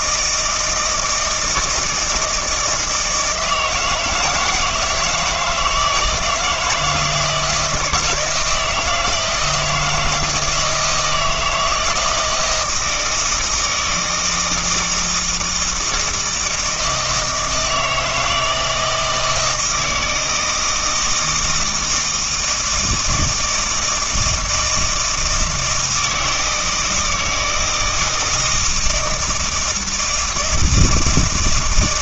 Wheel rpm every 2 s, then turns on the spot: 160, 160, 160, 160, 160, 160, 170, 160, 160, 160, 160, 160, 160, 160, 160, 160.
none